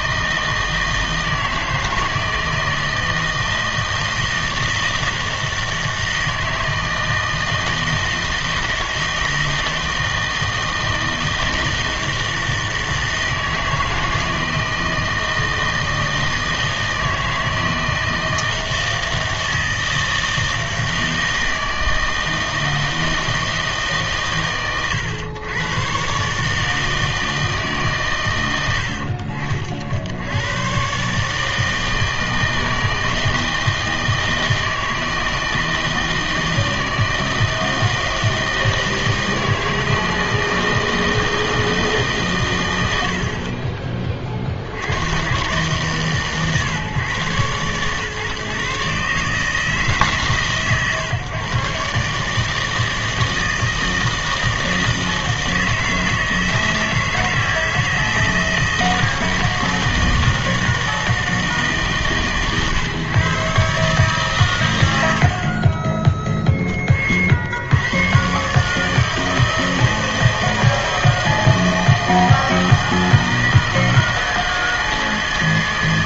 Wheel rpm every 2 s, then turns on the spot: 160, 160, 160, 160, 160, 160, 160, 160, 160, 160, 160, 160, 120, 160, 70, 130, 160, 160, 160, 160, 160, 80, 90, 130, 140, 130, 160, 160, 160, 160, 160, 130, 100, 30, 150, 160, 160, 160.
none